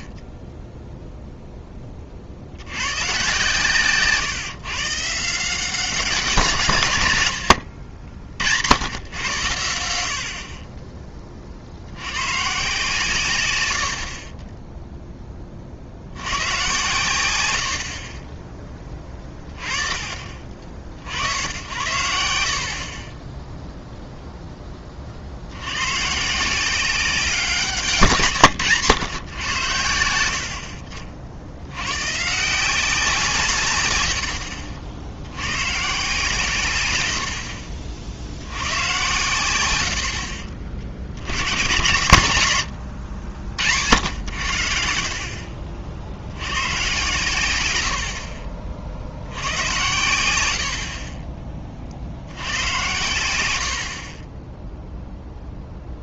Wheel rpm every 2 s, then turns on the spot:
20, 80, 150, 140, 90, 30, 140, 10, 110, 20, 30, 50, 20, 170, 130, 60, 170, 70, 110, 100, 50, 110, 70, 110, 50, 60, 100, 10.
30-32 42-44 54-56